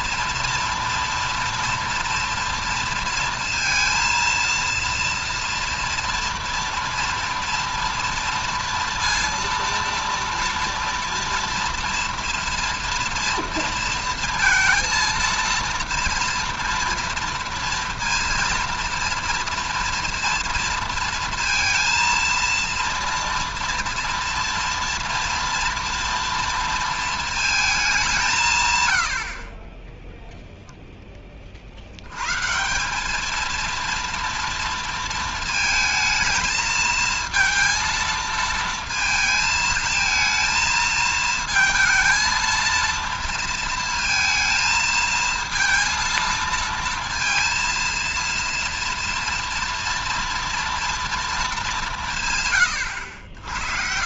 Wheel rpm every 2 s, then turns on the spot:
230, 230, 230, 230, 230, 230, 230, 230, 240, 230, 230, 230, 230, 230, 140, 0, 170, 230, 220, 230, 220, 230, 220, 230, 230, 230, 120.
none